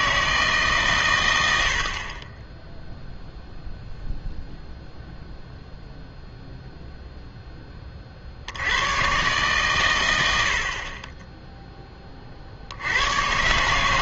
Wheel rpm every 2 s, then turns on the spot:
150, 10, 0, 0, 80, 70, 70.
none